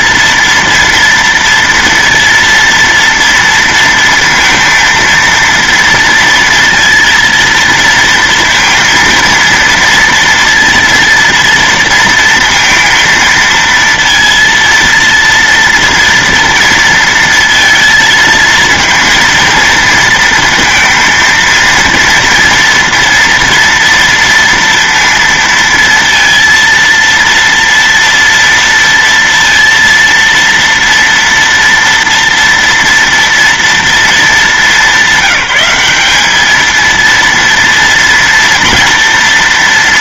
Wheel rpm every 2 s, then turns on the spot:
230, 230, 230, 230, 230, 230, 230, 230, 230, 220, 230, 230, 230, 230, 230, 230, 230, 200, 220, 230.
none